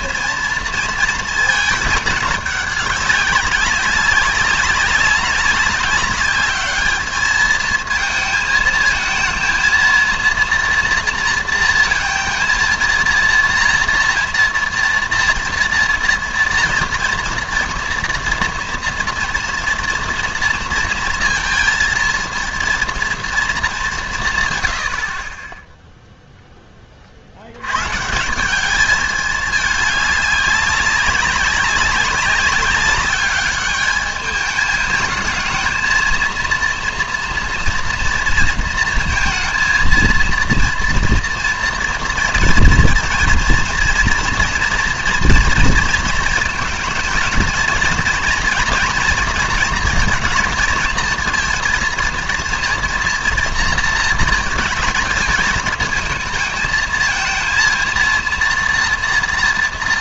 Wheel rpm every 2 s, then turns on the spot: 230, 210, 200, 210, 220, 230, 230, 230, 240, 240, 230, 230, 120, 10, 200, 200, 200, 210, 230, 230, 230, 230, 240, 230, 240, 230, 230, 220, 220, 230.
none